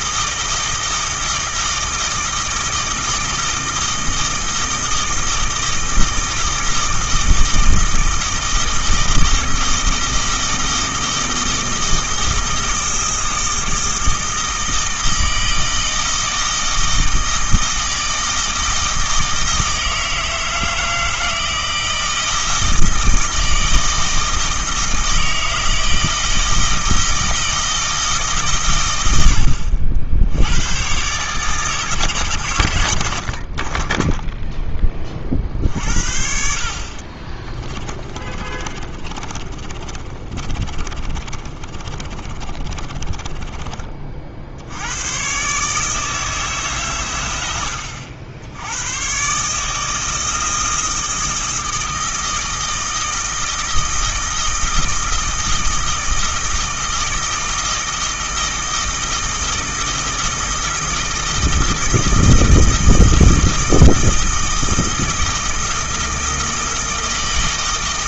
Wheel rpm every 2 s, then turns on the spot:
160, 160, 160, 160, 160, 160, 160, 160, 160, 160, 160, 160, 160, 160, 100, 130, 70, 30, 40, 30, 30, 20, 100, 120, 110, 160, 160, 160, 160, 160, 160, 160, 160, 160.
36-44